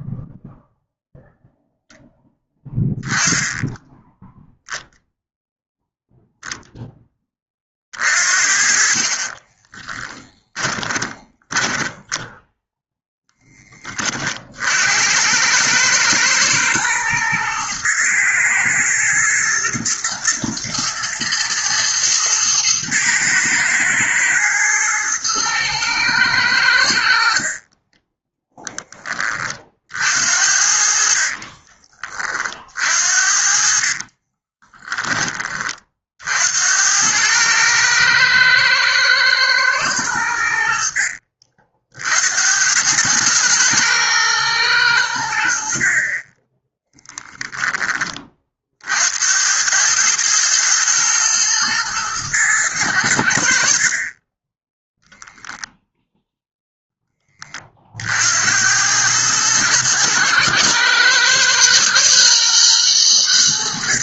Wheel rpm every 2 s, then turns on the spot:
0, 10, 0, 10, 40, 20, 0, 70, 110, 110, 110, 110, 110, 70, 20, 60, 50, 10, 90, 110, 70, 100, 100, 10, 60, 110, 90, 10, 0, 90, 110, 110.
10-12 30-32 34-36